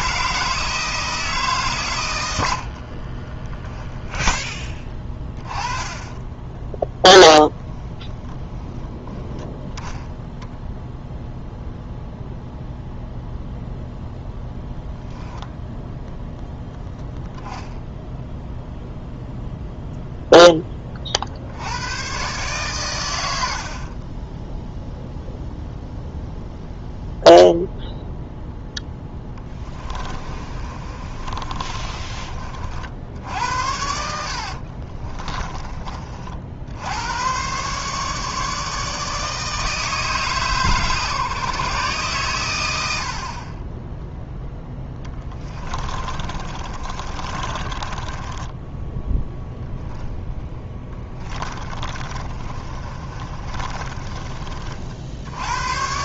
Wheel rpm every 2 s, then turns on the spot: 160, 50, 10, 10, 10, 0, 0, 0, 0, 0, 20, 120, 0, 0, 0, 30, 60, 40, 70, 150, 140, 90, 10, 30, 10, 20, 30, 50.
2-6 30-32 34-36 44-48 50-54